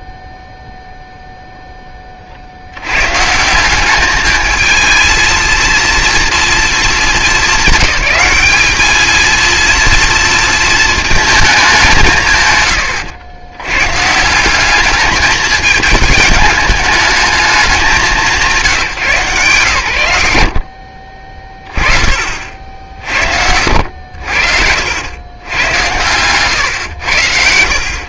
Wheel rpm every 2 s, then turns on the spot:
0, 70, 220, 220, 210, 220, 130, 200, 210, 160, 70, 70, 70, 120.
none